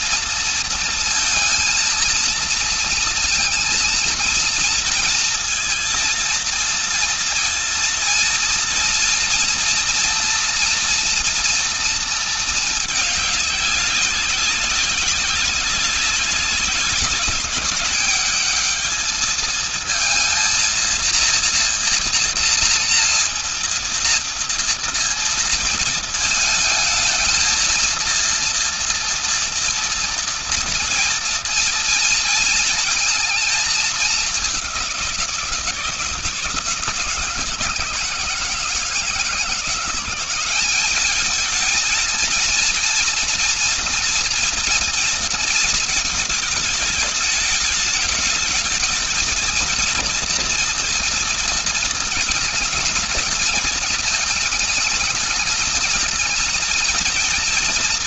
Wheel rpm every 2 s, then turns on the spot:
230, 230, 230, 230, 230, 230, 220, 200, 190, 210, 230, 230, 230, 220, 230, 230, 220, 190, 160, 160, 200, 240, 230, 210, 220, 230, 210, 220, 230.
none